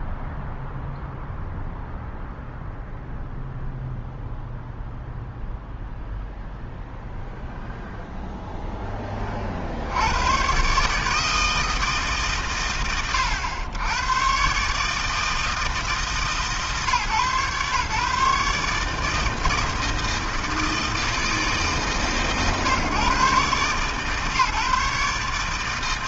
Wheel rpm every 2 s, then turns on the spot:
0, 0, 0, 0, 50, 160, 90, 150, 130, 160, 150, 140, 150.
none